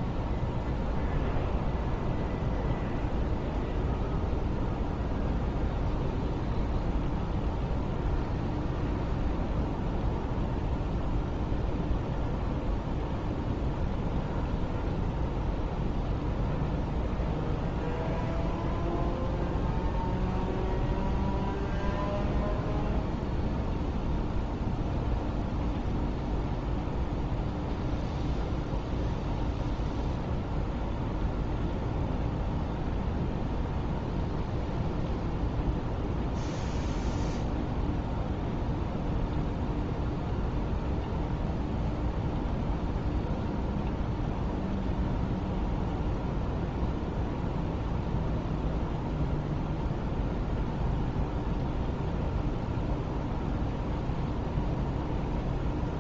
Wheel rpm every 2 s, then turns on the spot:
0, 0, 0, 0, 0, 0, 0, 0, 0, 0, 0, 0, 0, 0, 0, 0, 0, 0, 0, 0, 0, 0, 0, 0, 0, 0, 0, 0.
none